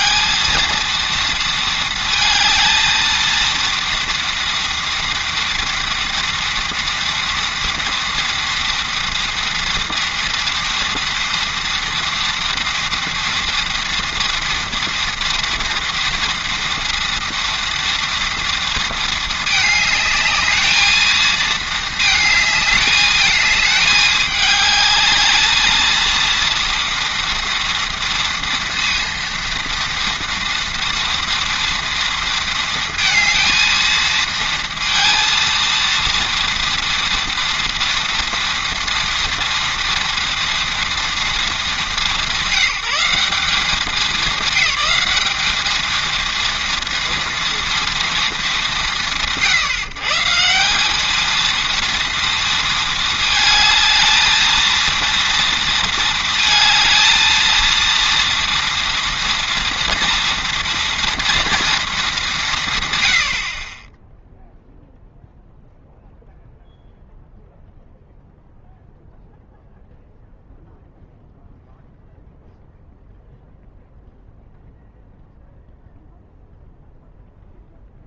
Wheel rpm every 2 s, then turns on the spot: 230, 230, 230, 230, 230, 230, 230, 230, 230, 230, 220, 210, 210, 230, 230, 230, 230, 230, 230, 230, 230, 160, 200, 230, 190, 170, 230, 230, 220, 230, 230, 170, 0, 0, 0, 0, 0, 0, 0.
none